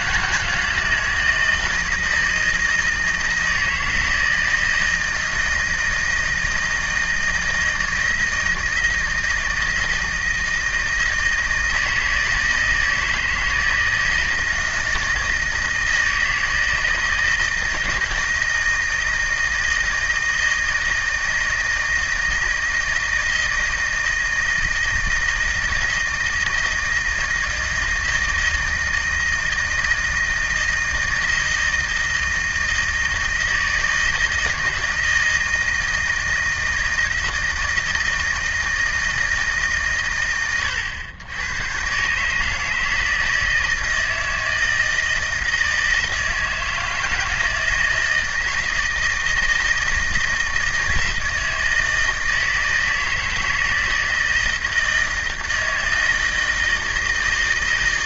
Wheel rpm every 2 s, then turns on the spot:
160, 160, 160, 160, 160, 160, 160, 160, 170, 160, 160, 160, 160, 160, 160, 160, 160, 160, 160, 160, 100, 160, 160, 160, 160, 160, 160, 160, 160.
none